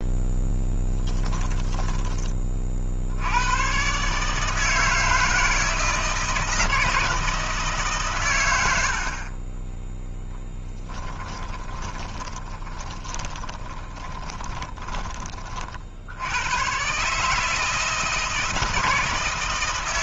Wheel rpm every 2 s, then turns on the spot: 10, 40, 150, 160, 90, 10, 30, 20, 110, 160.
10-16